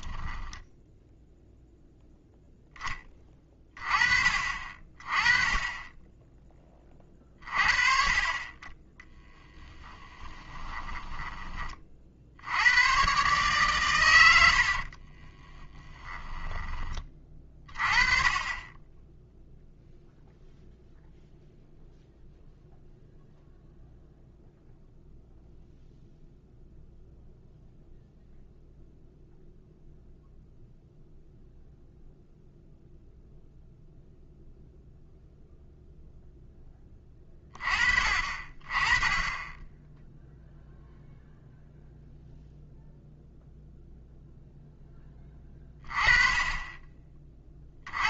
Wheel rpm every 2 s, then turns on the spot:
0, 10, 40, 20, 20, 10, 100, 70, 20, 20, 0, 0, 0, 0, 0, 0, 0, 0, 10, 20, 0, 0, 10, 20.
10-12 14-16